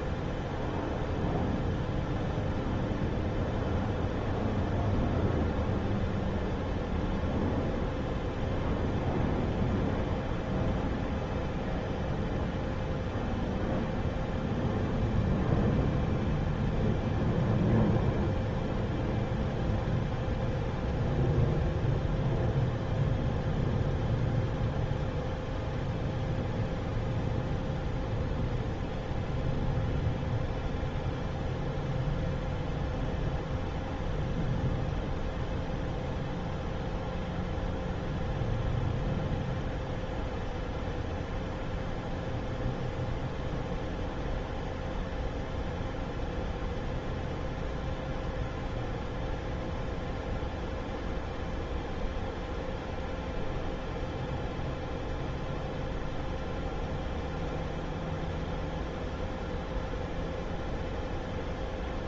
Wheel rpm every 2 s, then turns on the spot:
0, 0, 0, 0, 0, 0, 0, 0, 0, 0, 0, 0, 0, 0, 0, 0, 0, 0, 0, 0, 0, 0, 0, 0, 0, 0, 0, 0, 0, 0, 0.
none